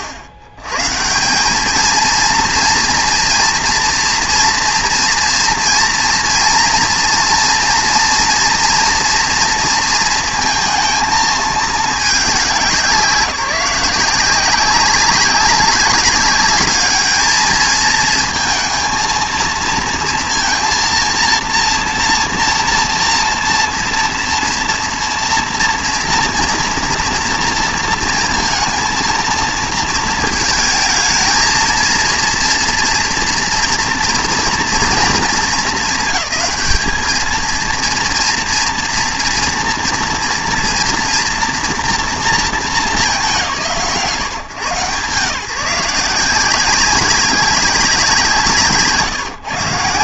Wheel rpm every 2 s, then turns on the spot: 130, 230, 230, 230, 230, 230, 180, 190, 210, 230, 230, 230, 230, 230, 230, 220, 240, 220, 210, 230, 240, 200, 140, 180, 180.
none